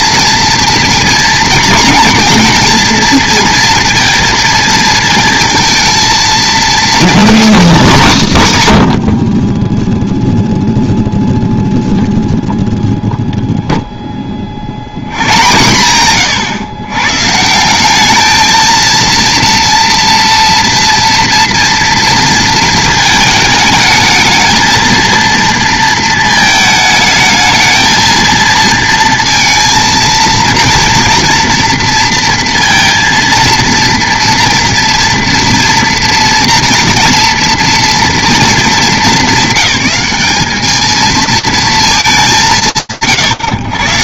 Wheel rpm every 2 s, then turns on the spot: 230, 230, 230, 230, 200, 0, 0, 10, 110, 210, 230, 230, 220, 220, 230, 230, 230, 230, 230, 240, 210, 170.
none